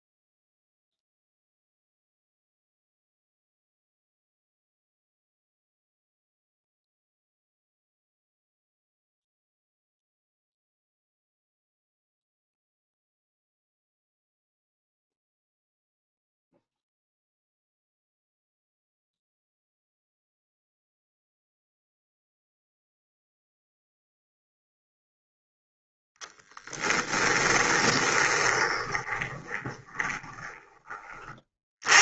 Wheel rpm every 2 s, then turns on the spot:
0, 0, 0, 0, 0, 0, 0, 0, 0, 0, 0, 0, 0, 10, 20, 20.
28-32